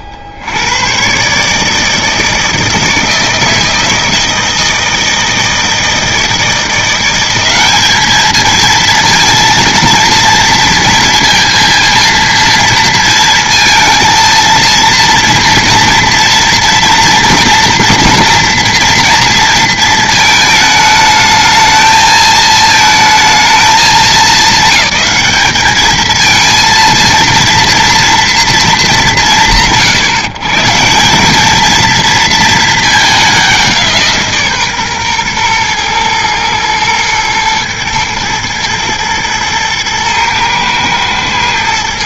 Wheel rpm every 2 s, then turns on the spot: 80, 160, 160, 170, 220, 230, 230, 230, 230, 230, 220, 220, 190, 220, 190, 160, 220, 130, 120, 110, 110.
none